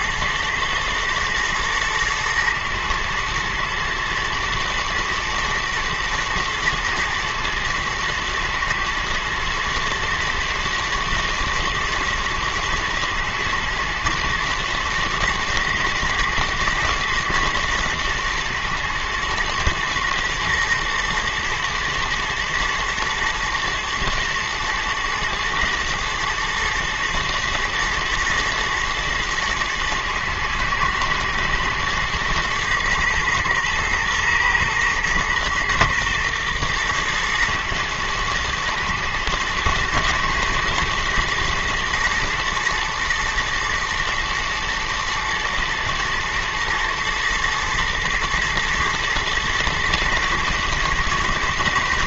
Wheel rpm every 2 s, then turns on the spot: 110, 110, 120, 110, 110, 110, 110, 110, 120, 120, 120, 110, 110, 110, 120, 120, 110, 120, 110, 110, 120, 120, 110, 110, 110, 120.
none